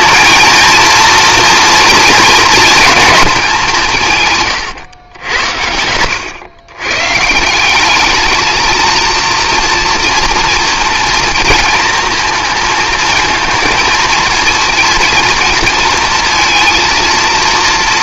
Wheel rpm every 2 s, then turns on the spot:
230, 230, 120, 110, 220, 230, 220, 230, 230.
none